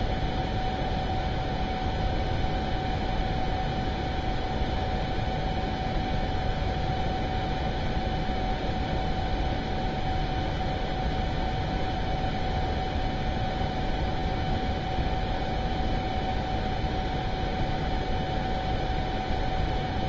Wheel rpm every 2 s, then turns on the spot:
0, 0, 0, 0, 0, 0, 0, 0, 0, 0.
none